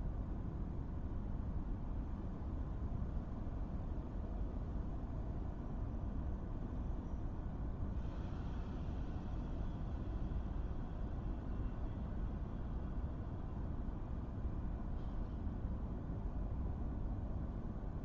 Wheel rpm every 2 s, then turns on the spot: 0, 0, 0, 0, 0, 0, 0, 0, 0.
none